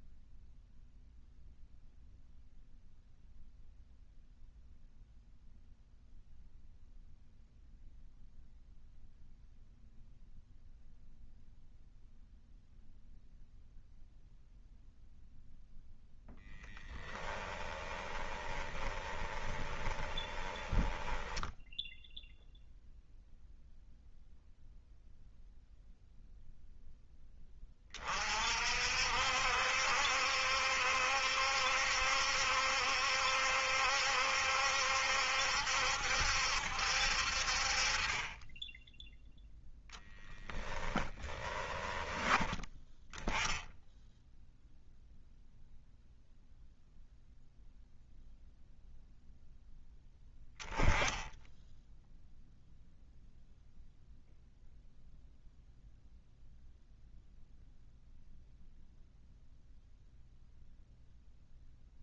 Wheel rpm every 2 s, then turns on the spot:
0, 0, 0, 0, 0, 0, 0, 0, 10, 20, 10, 0, 0, 10, 60, 70, 70, 70, 60, 10, 20, 10, 0, 0, 0, 10, 0, 0, 0, 0, 0.
16-22 40-42